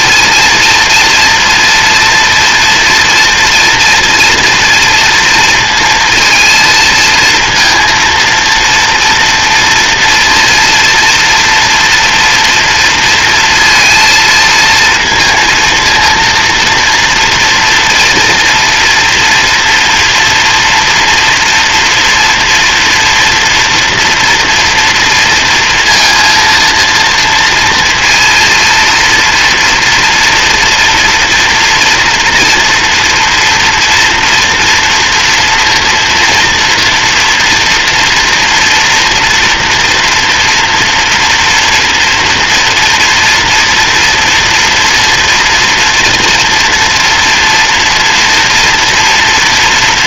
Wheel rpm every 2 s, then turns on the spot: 230, 240, 230, 230, 230, 230, 230, 230, 230, 230, 230, 230, 230, 230, 230, 240, 230, 240, 230, 240, 230, 230, 230, 230, 230.
none